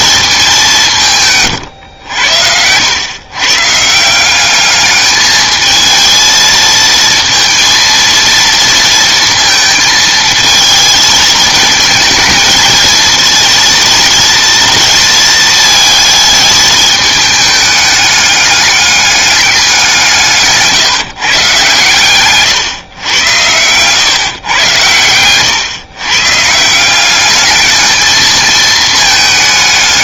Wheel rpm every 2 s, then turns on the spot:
200, 90, 200, 220, 230, 220, 230, 230, 220, 210, 160, 130, 130, 150, 220.
none